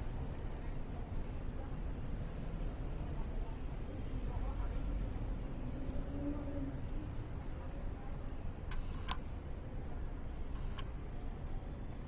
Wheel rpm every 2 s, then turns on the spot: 0, 0, 0, 0, 0, 0.
none